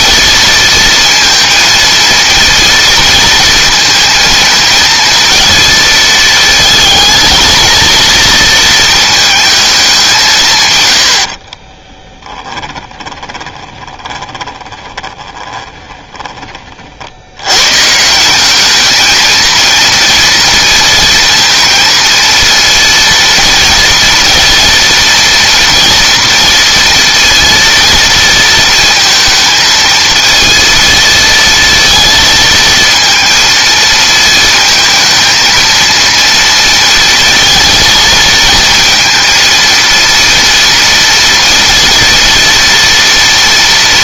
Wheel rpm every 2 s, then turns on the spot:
230, 230, 230, 220, 220, 90, 10, 20, 40, 210, 230, 230, 230, 230, 230, 230, 230, 220, 230, 230, 230, 230.
12-16